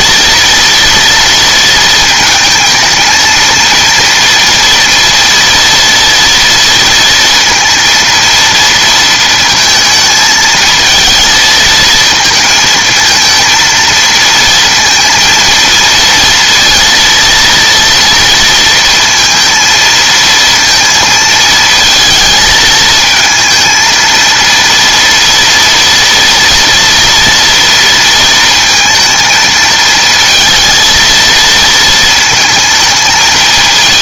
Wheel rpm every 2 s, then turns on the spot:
230, 220, 230, 230, 230, 220, 230, 230, 230, 230, 230, 220, 230, 240, 230, 220, 220.
none